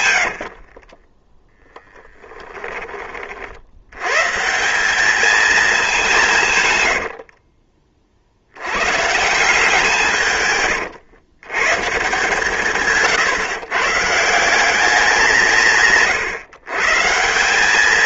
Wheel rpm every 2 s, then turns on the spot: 50, 20, 180, 120, 110, 120, 140, 180, 140.
0-2